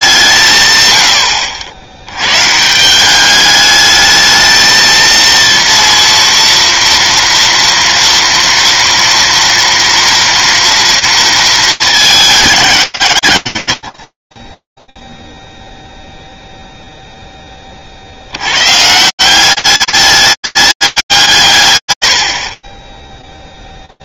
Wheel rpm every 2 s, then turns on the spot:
180, 120, 220, 230, 230, 240, 200, 30, 0, 100, 210, 50.
none